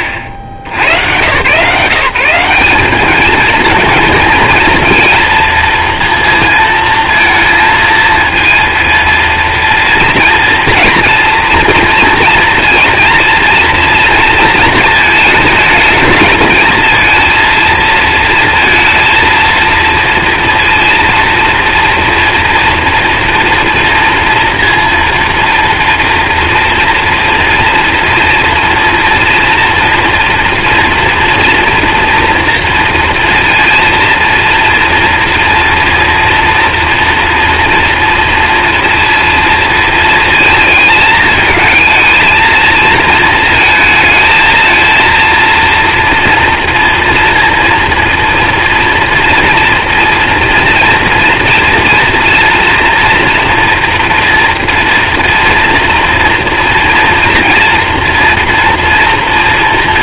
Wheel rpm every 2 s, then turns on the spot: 90, 200, 230, 230, 230, 230, 230, 230, 230, 230, 230, 230, 230, 230, 230, 230, 230, 240, 230, 230, 220, 230, 230, 230, 230, 230, 240, 230, 230, 230.
none